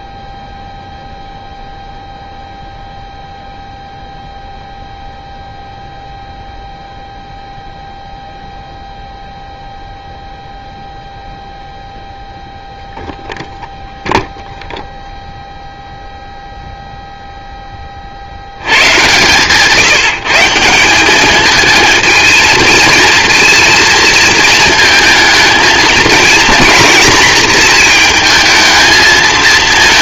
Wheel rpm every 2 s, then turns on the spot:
0, 0, 0, 0, 0, 0, 0, 0, 0, 90, 170, 220, 230, 240, 220.
none